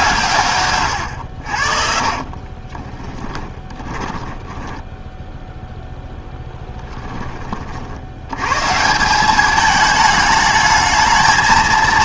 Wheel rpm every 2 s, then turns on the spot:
110, 20, 10, 10, 140, 220.
2-6